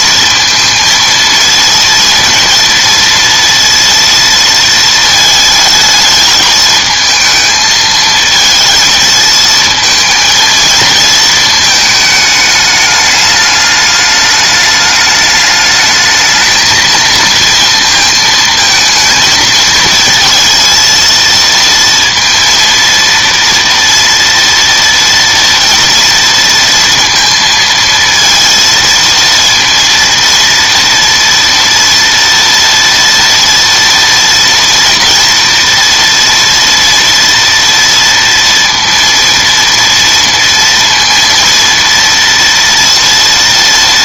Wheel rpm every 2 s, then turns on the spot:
230, 230, 230, 220, 230, 230, 210, 210, 220, 220, 230, 230, 230, 230, 230, 230, 230, 230, 240, 230, 230, 230.
none